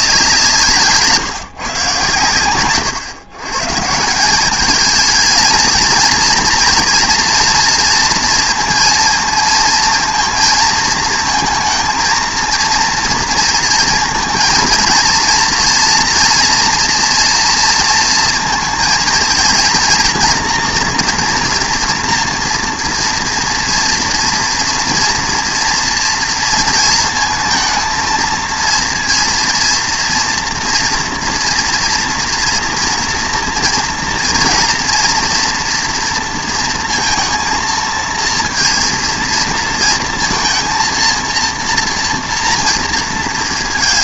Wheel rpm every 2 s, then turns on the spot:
150, 120, 210, 240, 230, 230, 230, 230, 230, 230, 230, 240, 230, 230, 230, 230, 230, 230, 230, 230, 230, 230.
none